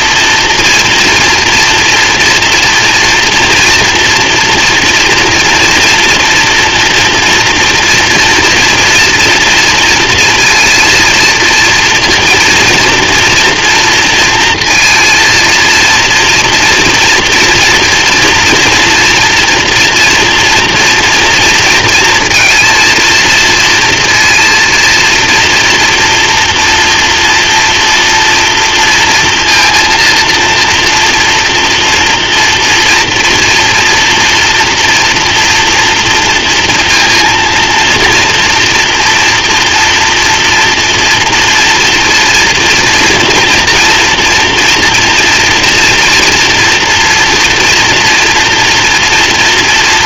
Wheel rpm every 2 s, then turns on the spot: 230, 230, 230, 240, 230, 230, 230, 230, 230, 240, 240, 230, 230, 230, 230, 230, 230, 240, 230, 230, 230, 230, 230, 230, 230.
none